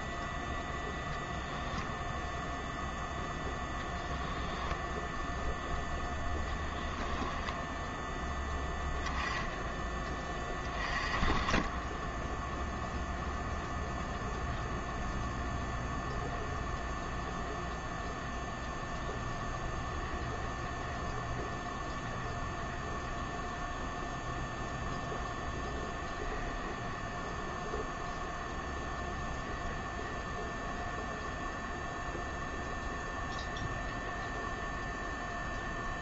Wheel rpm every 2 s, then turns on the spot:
0, 0, 0, 0, 10, 20, 0, 0, 0, 0, 0, 0, 0, 0, 0, 0, 0, 0.
none